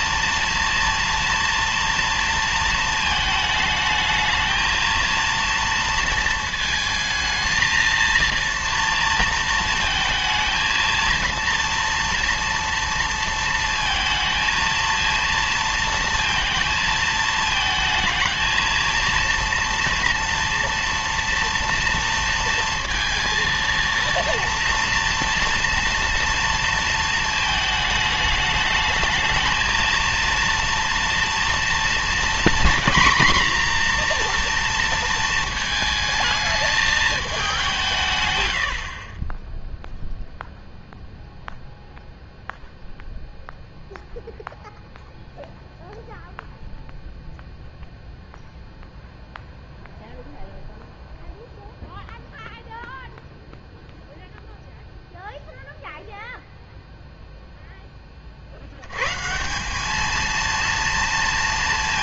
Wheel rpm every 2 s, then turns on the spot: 230, 230, 220, 220, 230, 230, 230, 230, 230, 220, 230, 230, 230, 230, 210, 230, 240, 240, 220, 90, 0, 0, 0, 0, 0, 0, 0, 0, 0, 50, 230.
none